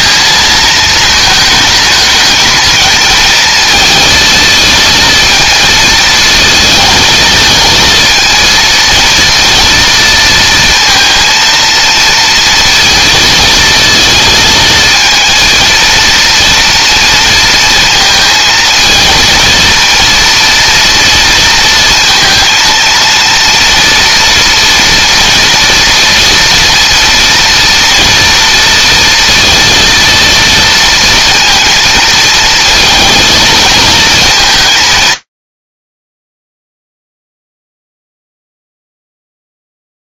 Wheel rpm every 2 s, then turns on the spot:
220, 220, 220, 220, 230, 230, 230, 230, 230, 230, 230, 230, 230, 230, 230, 230, 230, 150, 0, 0.
none